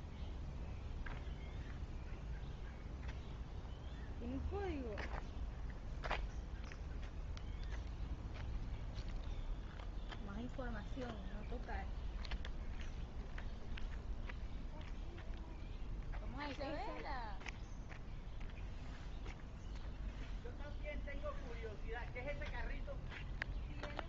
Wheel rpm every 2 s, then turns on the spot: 0, 0, 0, 0, 0, 0, 0, 0, 0, 0, 0, 0.
none